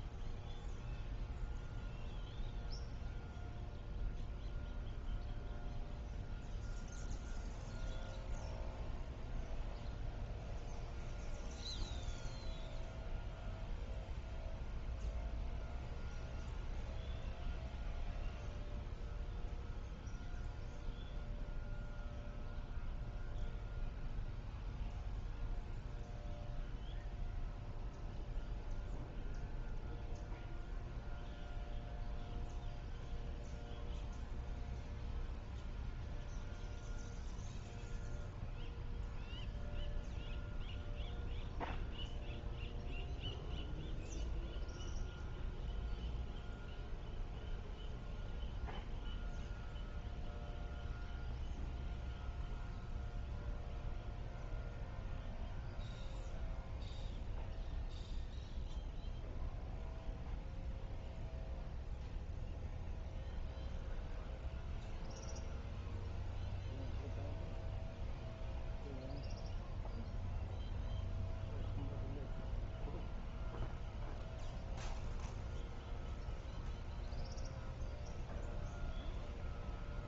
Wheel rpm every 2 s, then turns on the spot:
0, 0, 0, 0, 0, 0, 0, 0, 0, 0, 0, 0, 0, 0, 0, 0, 0, 0, 0, 0, 0, 0, 0, 0, 0, 0, 0, 0, 0, 0, 0, 0, 0, 0, 0, 0, 0, 0, 0, 0.
none